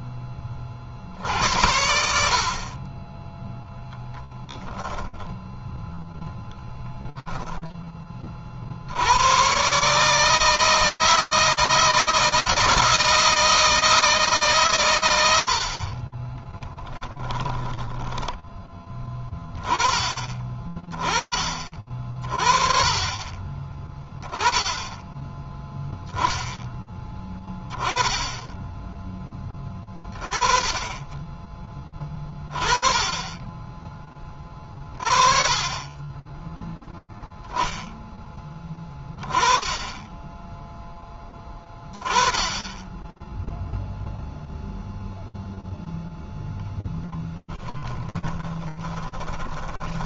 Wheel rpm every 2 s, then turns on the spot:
50, 30, 20, 10, 80, 160, 160, 120, 10, 10, 20, 20, 10, 10, 10, 10, 30, 40, 10, 20, 10, 10, 0, 0, 10.
4-6 16-18 48-50